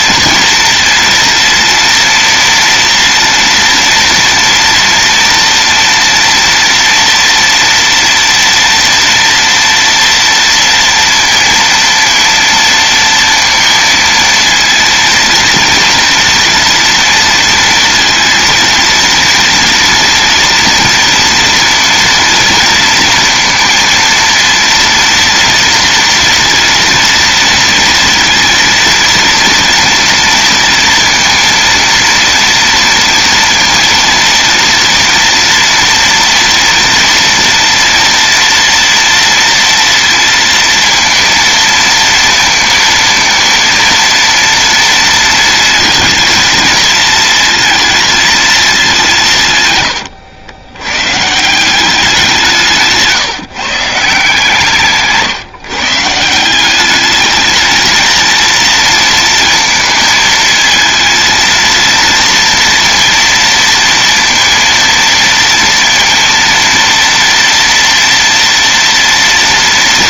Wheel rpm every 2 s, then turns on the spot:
230, 230, 230, 230, 230, 230, 230, 230, 230, 230, 230, 230, 230, 240, 230, 230, 230, 230, 230, 230, 230, 230, 230, 230, 220, 90, 170, 160, 170, 230, 230, 230, 230, 230, 230.
none